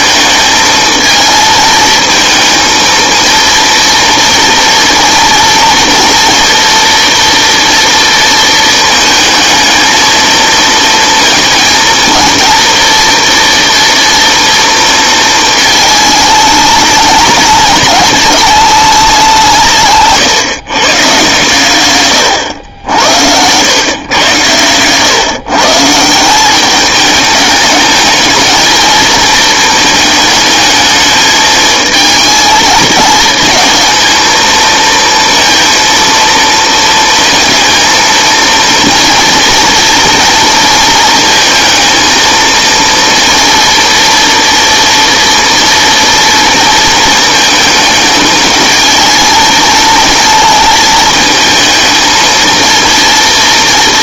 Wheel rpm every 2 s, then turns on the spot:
220, 230, 230, 230, 220, 230, 230, 230, 210, 180, 130, 90, 130, 210, 230, 220, 220, 230, 230, 230, 220, 230, 230, 220, 220, 220, 230.
none